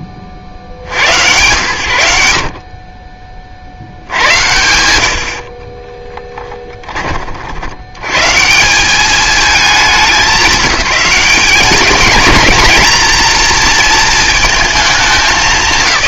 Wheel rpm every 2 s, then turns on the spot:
40, 60, 100, 10, 180, 200, 230, 220.
none